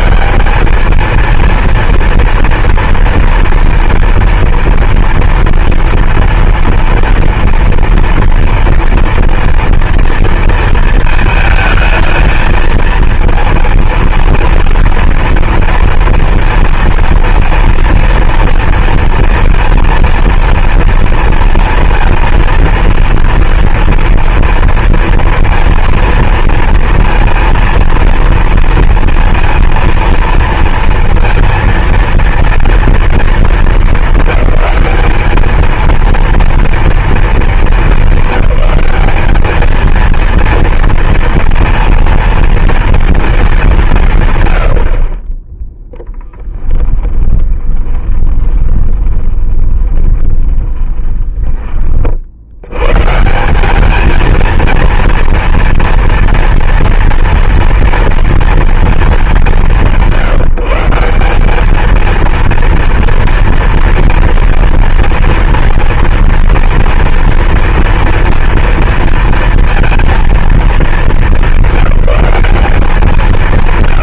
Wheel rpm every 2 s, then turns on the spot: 230, 230, 230, 230, 230, 220, 230, 230, 230, 230, 230, 230, 230, 230, 230, 230, 230, 210, 230, 210, 230, 230, 40, 20, 20, 10, 140, 230, 240, 190, 180, 230, 230, 230, 230, 210, 200.
46-50